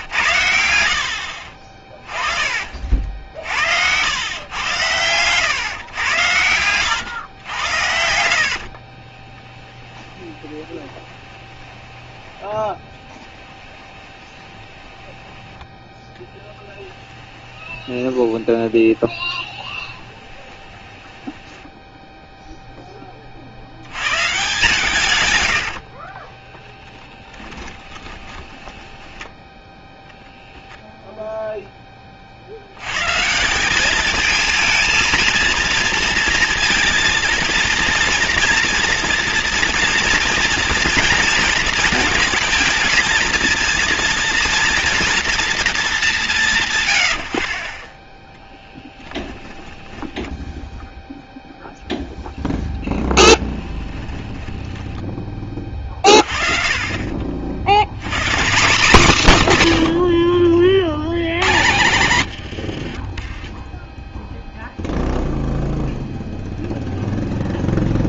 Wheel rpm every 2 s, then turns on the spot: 70, 50, 110, 110, 60, 20, 10, 10, 10, 20, 20, 10, 140, 10, 10, 0, 90, 220, 230, 230, 230, 220, 230, 130, 0, 0, 0, 20, 40, 190, 60, 80, 0, 0.
8-22 28-30 54-56 62-64